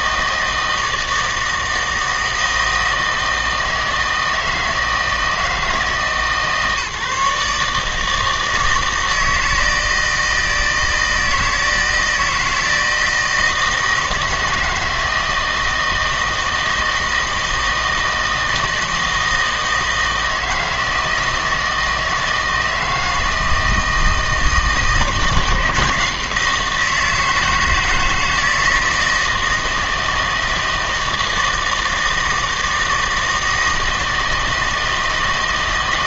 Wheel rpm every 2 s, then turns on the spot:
160, 160, 160, 150, 160, 160, 160, 160, 160, 160, 160, 160, 160, 170, 160, 160, 160, 160.
none